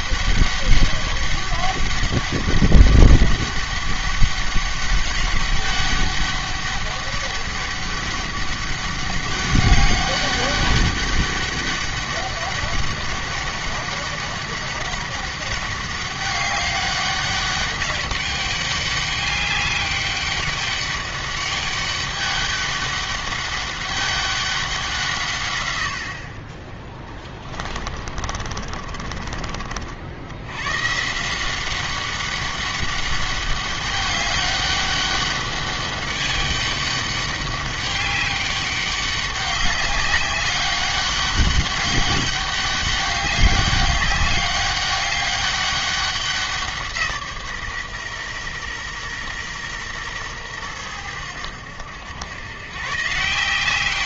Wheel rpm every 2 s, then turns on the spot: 200, 200, 200, 200, 200, 200, 200, 200, 200, 200, 200, 200, 180, 10, 30, 140, 200, 200, 200, 200, 200, 200, 200, 170, 120, 100, 130.
28-30